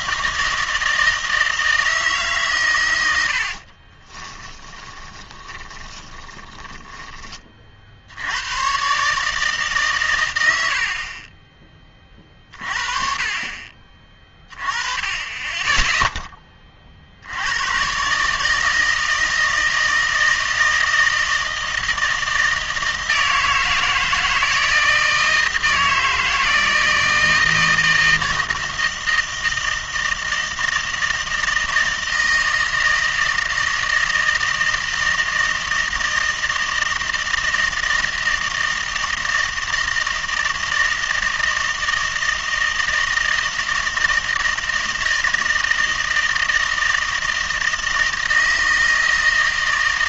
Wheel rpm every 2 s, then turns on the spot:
160, 130, 20, 20, 100, 90, 40, 20, 30, 160, 160, 160, 160, 160, 160, 160, 160, 160, 160, 160, 160, 160, 160, 160, 160.
4-8